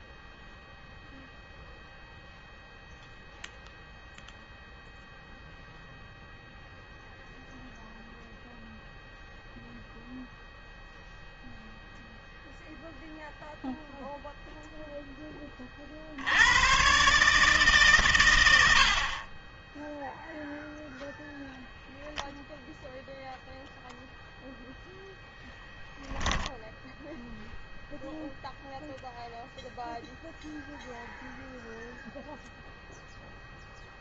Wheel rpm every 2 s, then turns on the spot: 0, 0, 0, 0, 0, 0, 0, 40, 130, 10, 0, 0, 0, 0, 0, 0, 0.
none